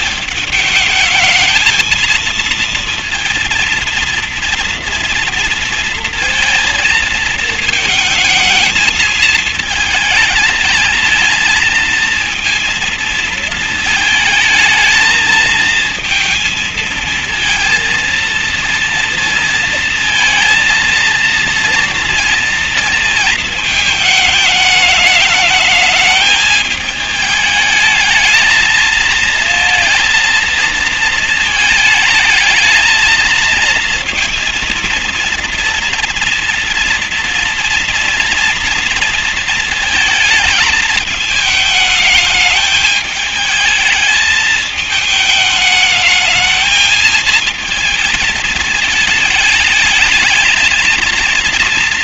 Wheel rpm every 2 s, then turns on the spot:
210, 230, 240, 230, 220, 220, 220, 220, 220, 230, 230, 230, 210, 210, 220, 230, 220, 230, 240, 230, 220, 210, 220, 220, 220, 220.
none